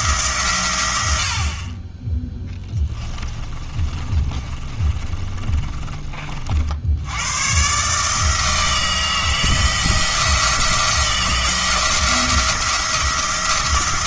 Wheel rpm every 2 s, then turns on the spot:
100, 20, 30, 70, 160, 170, 170.
2-6